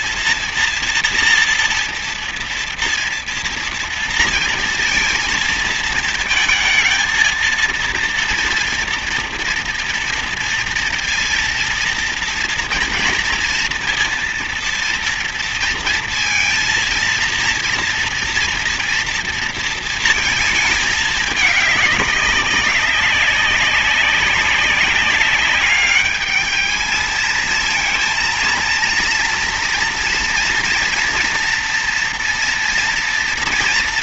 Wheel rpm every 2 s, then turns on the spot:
240, 230, 230, 220, 230, 230, 230, 230, 230, 230, 220, 200, 190, 210, 230, 240, 230.
none